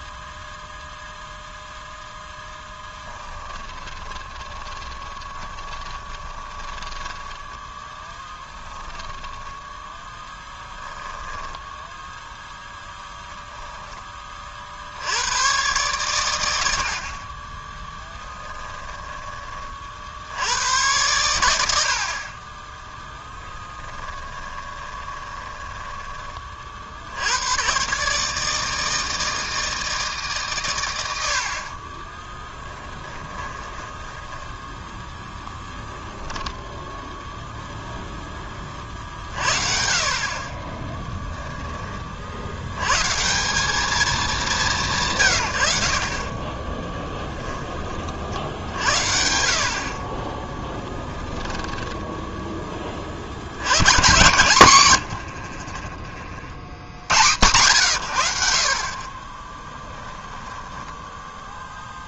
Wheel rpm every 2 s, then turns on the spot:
0, 10, 20, 20, 10, 10, 0, 50, 80, 10, 100, 10, 20, 50, 160, 120, 10, 10, 0, 30, 30, 100, 180, 20, 60, 10, 20, 110, 90, 50, 10.
2-8 10-12 18-20 22-26 32-34 40-42 46-48 50-52 54-56 60-62